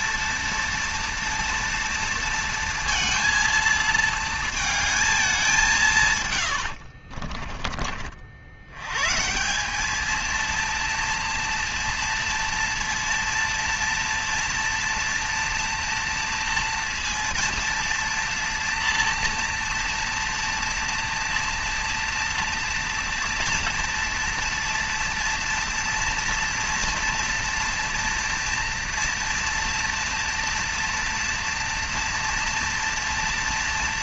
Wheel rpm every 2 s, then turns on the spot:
230, 230, 220, 130, 60, 220, 230, 230, 230, 230, 230, 240, 230, 230, 230, 230, 230.
6-8